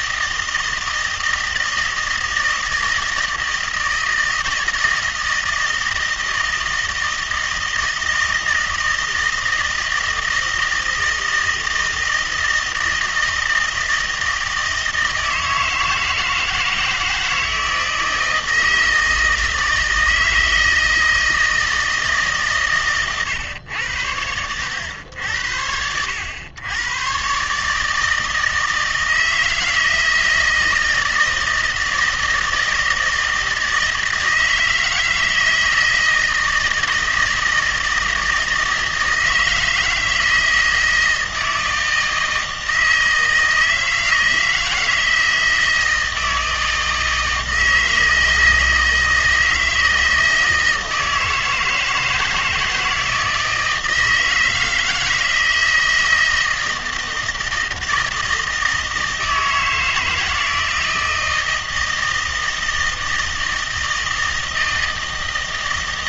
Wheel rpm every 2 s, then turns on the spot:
160, 160, 160, 160, 160, 160, 160, 160, 160, 160, 160, 130, 100, 100, 160, 160, 160, 160, 160, 160, 160, 160, 160, 160, 160, 160, 160, 160, 160, 160, 160, 160, 160.
none